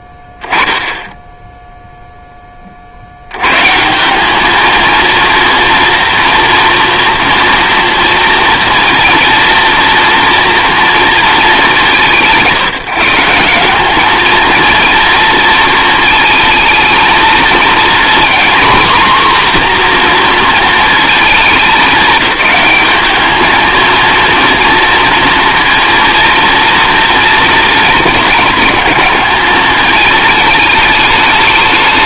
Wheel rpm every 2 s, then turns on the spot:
10, 30, 220, 230, 230, 230, 150, 230, 220, 240, 230, 210, 230, 230, 210, 210.
none